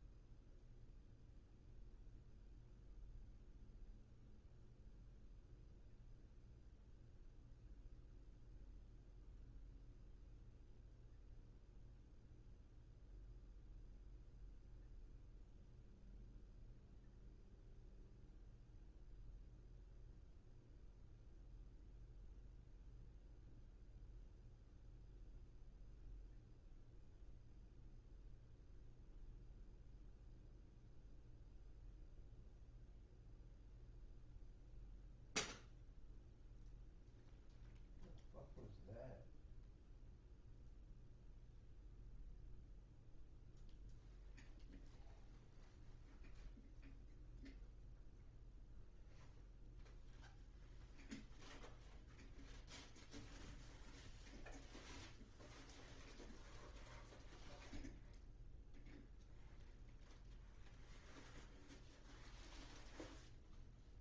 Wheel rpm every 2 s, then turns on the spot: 0, 0, 0, 0, 0, 0, 0, 0, 0, 0, 0, 0, 0, 0, 0, 0, 0, 0, 0, 0, 0, 0, 0, 0, 0, 0, 0, 0, 0, 0, 0, 0.
none